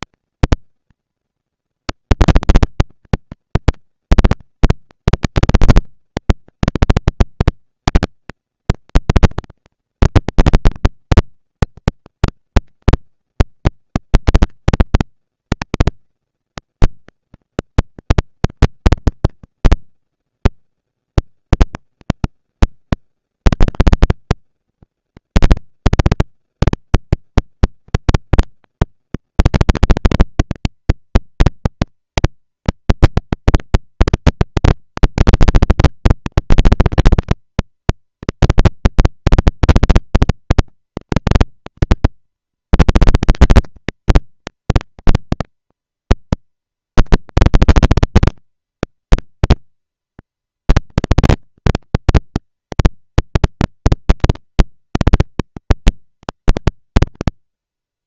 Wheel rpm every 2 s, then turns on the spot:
230, 230, 230, 230, 230, 230, 230, 230, 220, 230, 220, 200, 210, 230, 230, 240, 230, 230, 230, 230, 230, 230, 230, 230, 230, 230, 230, 200, 200.
none